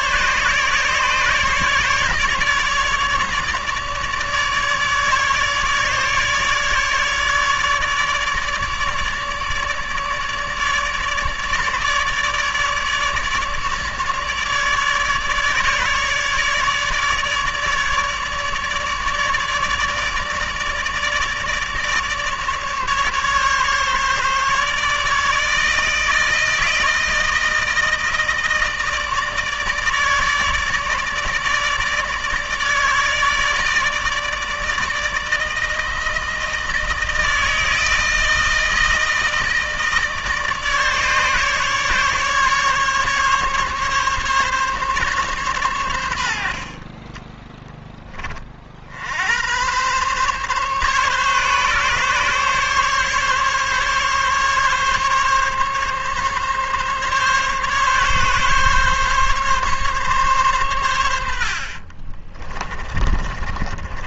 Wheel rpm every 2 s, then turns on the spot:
150, 150, 150, 150, 150, 150, 150, 150, 150, 150, 150, 150, 150, 160, 160, 150, 150, 160, 160, 160, 150, 140, 140, 30, 70, 140, 140, 140, 140, 140, 90, 20.
46-48 62-64